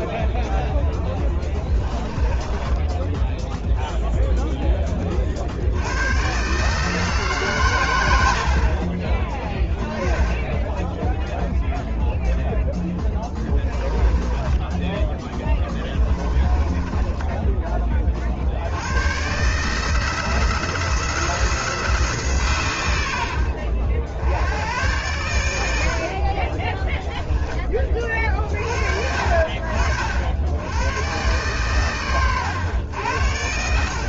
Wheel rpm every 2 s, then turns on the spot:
10, 10, 20, 150, 40, 10, 10, 10, 20, 80, 160, 110, 100, 10, 50, 100, 90.
0-4 10-12 16-18 26-28